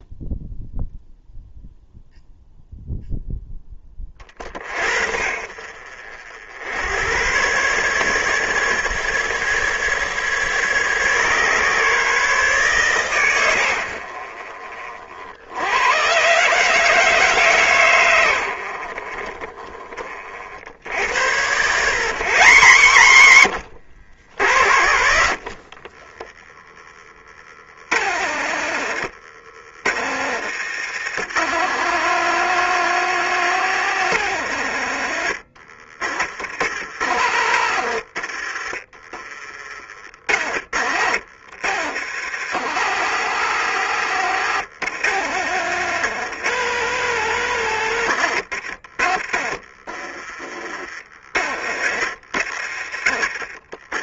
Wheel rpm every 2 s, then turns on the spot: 0, 0, 50, 90, 150, 140, 130, 40, 150, 60, 70, 150, 80, 20, 80, 110, 150, 100, 70, 30, 70, 100, 110, 140, 70, 40, 60.
38-40